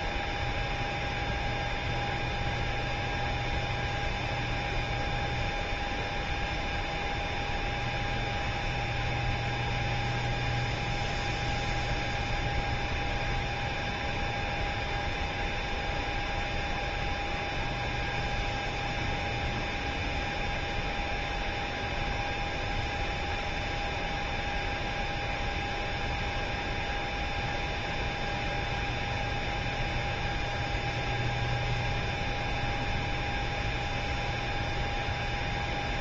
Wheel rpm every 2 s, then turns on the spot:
0, 0, 0, 0, 0, 0, 0, 0, 0, 0, 0, 0, 0, 0, 0, 0, 0, 0.
none